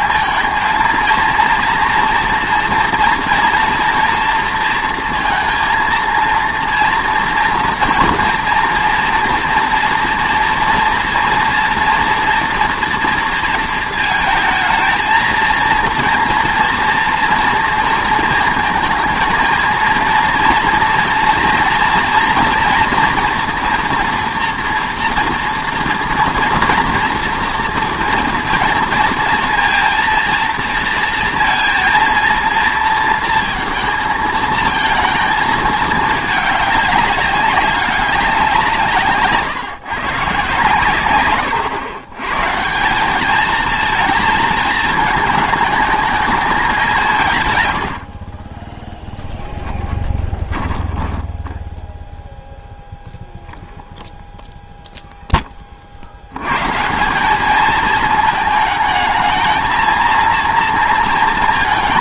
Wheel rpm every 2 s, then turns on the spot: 230, 230, 230, 230, 240, 230, 230, 220, 230, 230, 230, 230, 230, 240, 230, 230, 230, 220, 200, 170, 130, 170, 220, 200, 10, 10, 0, 0, 140, 220, 230.
48-52